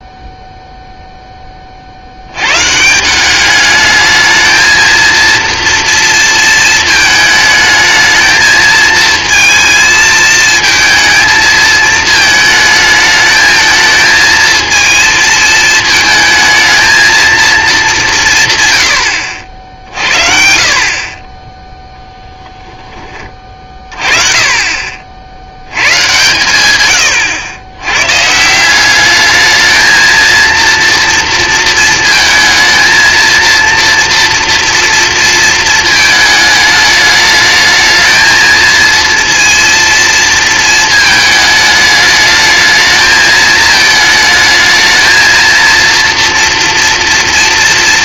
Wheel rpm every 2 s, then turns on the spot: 0, 150, 220, 220, 220, 220, 220, 230, 230, 100, 60, 10, 40, 110, 190, 230, 230, 230, 210, 220, 220, 220, 220, 230.
none